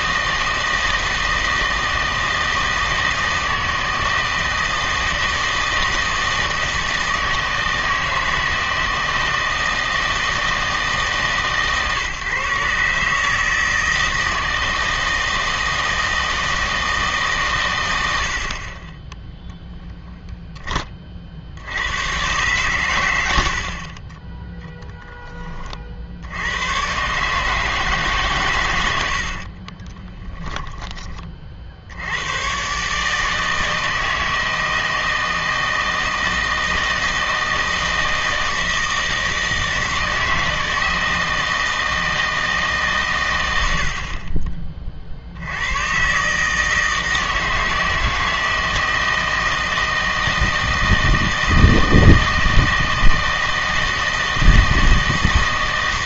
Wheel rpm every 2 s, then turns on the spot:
160, 160, 160, 160, 160, 160, 140, 160, 160, 30, 20, 120, 10, 100, 100, 20, 130, 160, 160, 160, 160, 150, 30, 160, 160, 160, 160, 160.
none